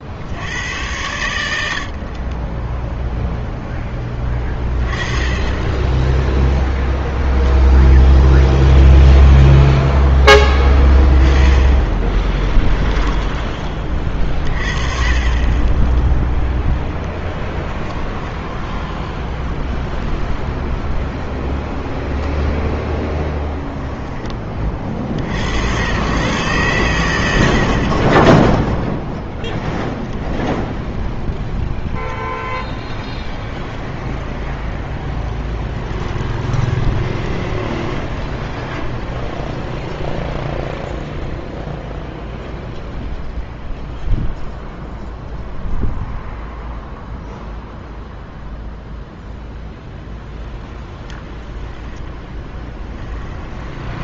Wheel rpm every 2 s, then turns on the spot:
100, 10, 20, 10, 10, 10, 10, 30, 10, 10, 0, 0, 30, 120, 0, 0, 10, 10, 20, 0, 0, 0, 0, 0, 0, 10, 10.
4-8 10-14 32-38 52-54